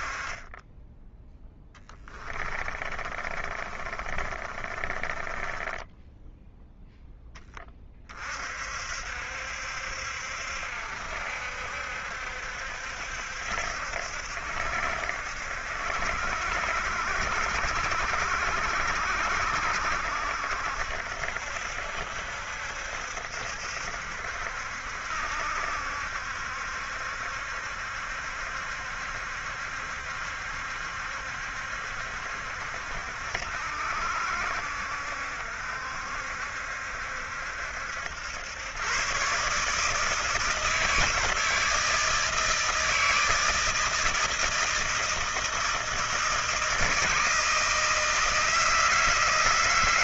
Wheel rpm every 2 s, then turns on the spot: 20, 30, 30, 0, 50, 70, 70, 70, 60, 60, 70, 60, 70, 70, 70, 70, 70, 70, 70, 110, 160, 160, 160, 160, 160.
2-6